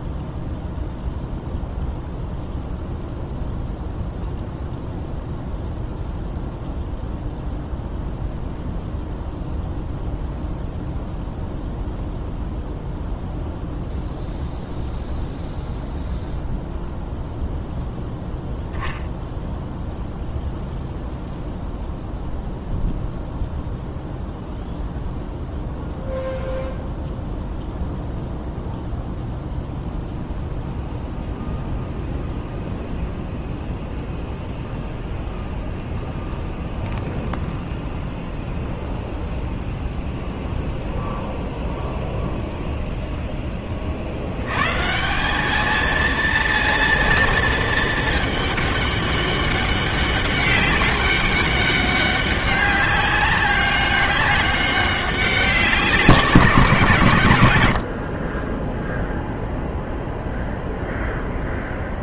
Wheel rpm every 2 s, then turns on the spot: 0, 0, 0, 0, 0, 0, 0, 0, 0, 0, 0, 0, 0, 0, 0, 0, 0, 0, 0, 0, 0, 0, 120, 230, 210, 200, 200, 200, 150, 0, 0.
none